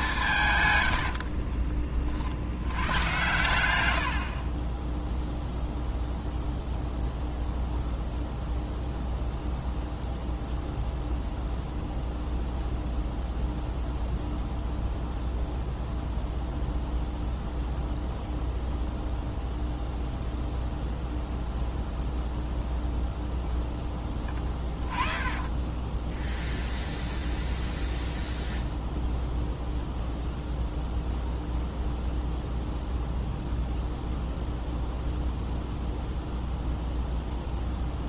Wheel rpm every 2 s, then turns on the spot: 110, 110, 10, 0, 0, 0, 0, 0, 0, 0, 0, 0, 10, 0, 0, 0, 0, 0, 0.
0-2 24-26